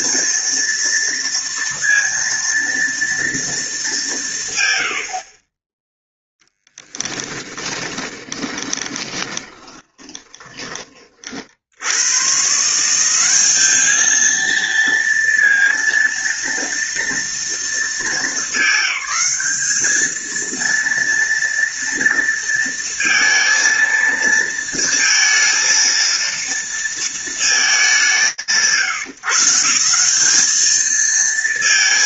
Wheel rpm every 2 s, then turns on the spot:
230, 230, 120, 10, 20, 20, 160, 230, 230, 210, 230, 230, 230, 230, 140, 210.
6-10